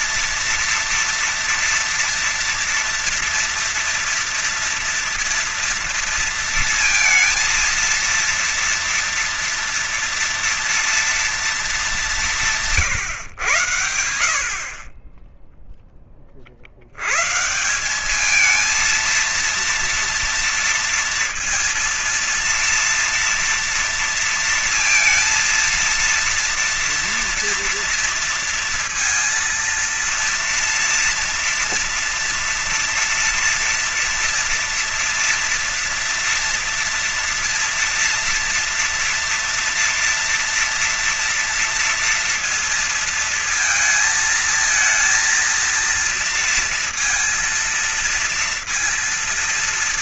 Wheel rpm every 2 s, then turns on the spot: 230, 230, 230, 230, 230, 230, 170, 50, 50, 210, 230, 230, 230, 230, 230, 230, 230, 230, 240, 230, 230, 230, 230, 230, 230.
none